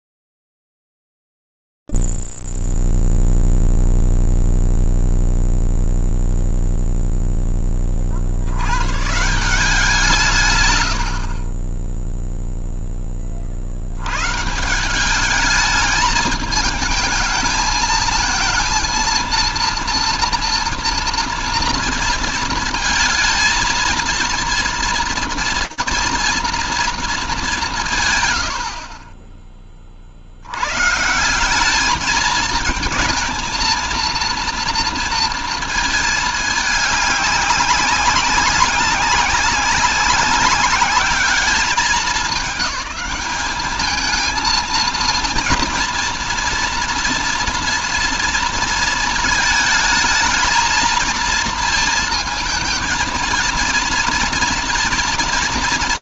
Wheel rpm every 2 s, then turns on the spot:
0, 0, 0, 0, 10, 170, 40, 70, 210, 220, 230, 230, 230, 230, 180, 50, 210, 230, 220, 200, 200, 210, 220, 230, 230, 220, 230, 230.
none